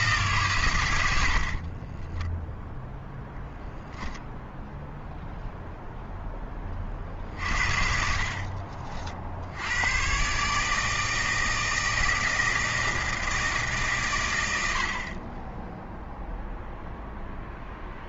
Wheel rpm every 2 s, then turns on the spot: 90, 0, 0, 30, 50, 150, 160, 70, 0.
none